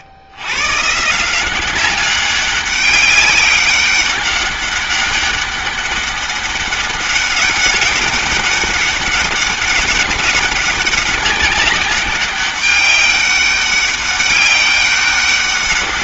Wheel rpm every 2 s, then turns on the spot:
170, 200, 200, 200, 200, 200, 200, 190.
none